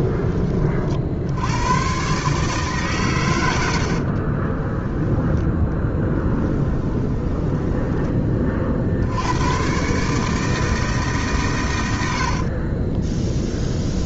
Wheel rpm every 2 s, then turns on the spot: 50, 130, 10, 10, 60, 150, 40.
4-8 12-14